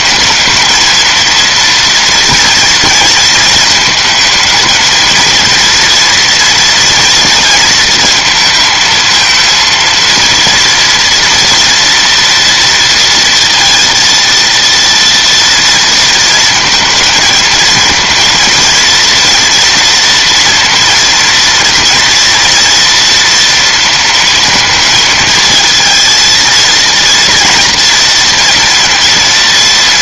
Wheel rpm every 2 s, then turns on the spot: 220, 230, 230, 230, 230, 230, 230, 230, 220, 230, 230, 230, 230, 230, 230.
none